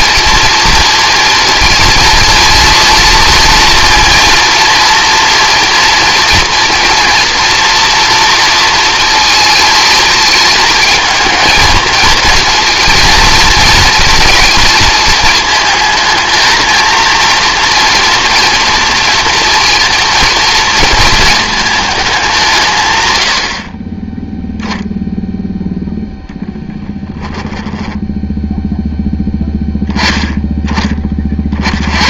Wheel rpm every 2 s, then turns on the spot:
230, 230, 230, 230, 230, 220, 230, 220, 230, 230, 230, 120, 0, 10, 0, 20.
26-28